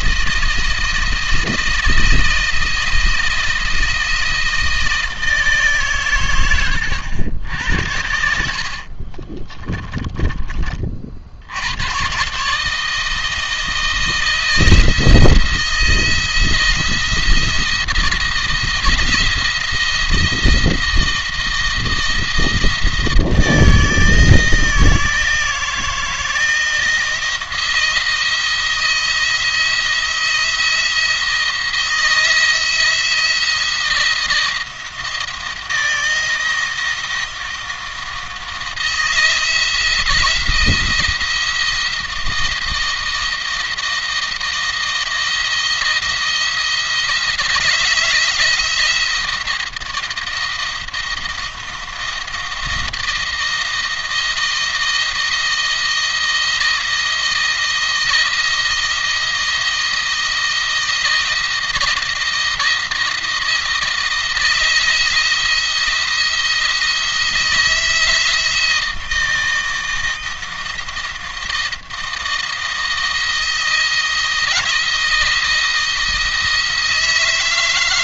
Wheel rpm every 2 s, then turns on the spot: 160, 160, 160, 100, 60, 40, 150, 170, 170, 170, 170, 160, 160, 160, 170, 170, 170, 170, 170, 170, 160, 160, 160, 170, 170, 170, 170, 170, 160, 160, 160, 170, 170, 170, 170, 160, 160, 170, 160.
8-10